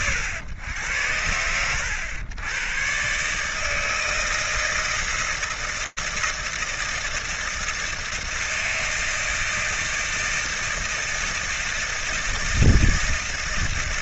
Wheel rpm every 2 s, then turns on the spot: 100, 120, 160, 160, 160, 160, 160.
none